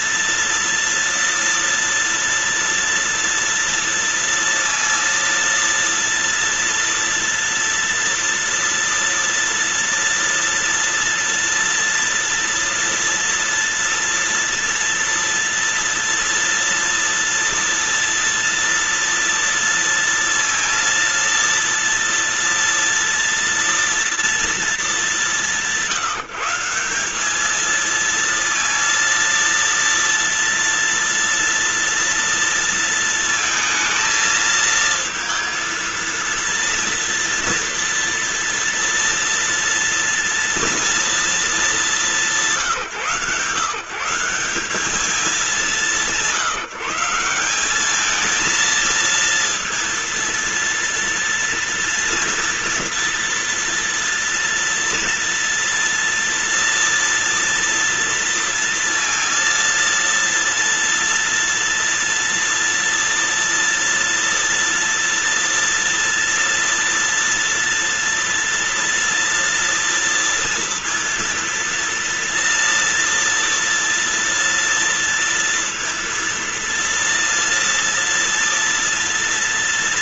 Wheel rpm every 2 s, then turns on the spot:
230, 230, 230, 230, 230, 230, 230, 230, 230, 230, 230, 230, 200, 190, 230, 230, 230, 230, 230, 230, 230, 170, 200, 160, 230, 230, 240, 230, 230, 230, 230, 230, 230, 230, 230, 230, 230, 230, 230, 230.
none